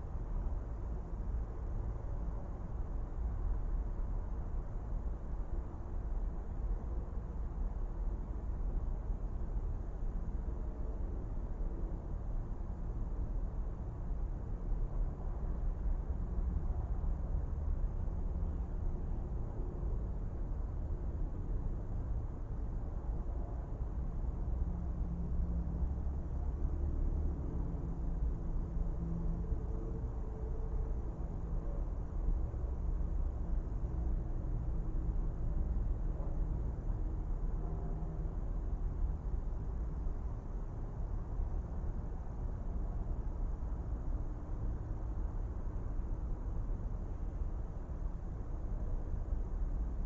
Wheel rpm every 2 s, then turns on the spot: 0, 0, 0, 0, 0, 0, 0, 0, 0, 0, 0, 0, 0, 0, 0, 0, 0, 0, 0, 0, 0, 0, 0, 0, 0.
none